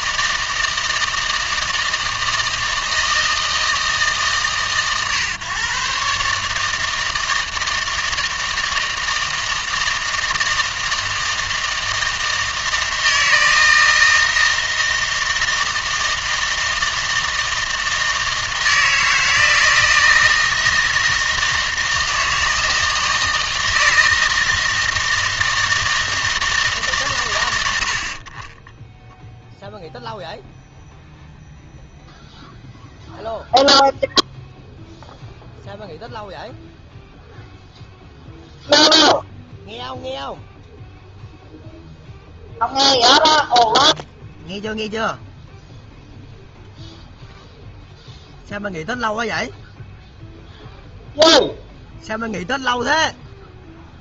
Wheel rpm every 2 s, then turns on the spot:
160, 160, 140, 150, 160, 160, 160, 160, 160, 160, 160, 160, 160, 140, 10, 0, 0, 0, 0, 0, 0, 0, 0, 0, 0, 0, 0.
28-30